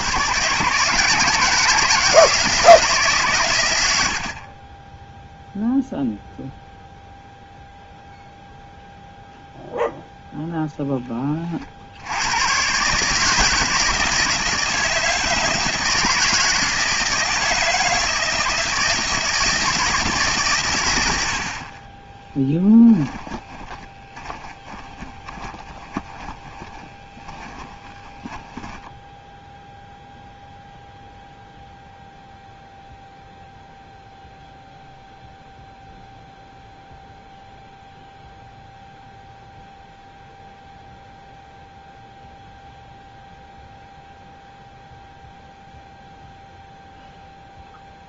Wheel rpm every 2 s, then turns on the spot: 150, 160, 20, 0, 0, 10, 130, 160, 160, 160, 120, 10, 20, 20, 10, 0, 0, 0, 0, 0, 0, 0, 0, 0.
22-30